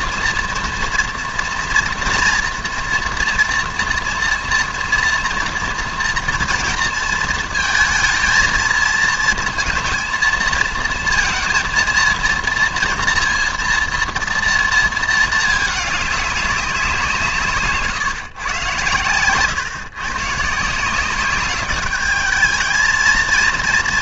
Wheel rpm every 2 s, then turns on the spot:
230, 230, 230, 230, 230, 230, 230, 230, 190, 130, 160, 210.
none